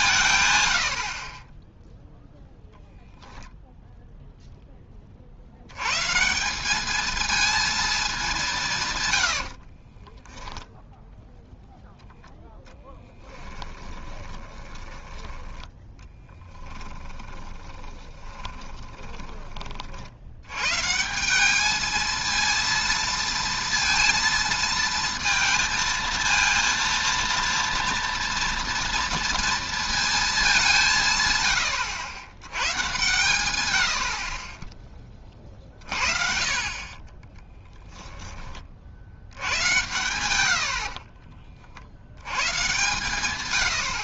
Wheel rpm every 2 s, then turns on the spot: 110, 0, 10, 190, 160, 10, 10, 20, 10, 20, 120, 230, 220, 230, 230, 190, 110, 20, 50, 30, 70, 120.
12-20 34-36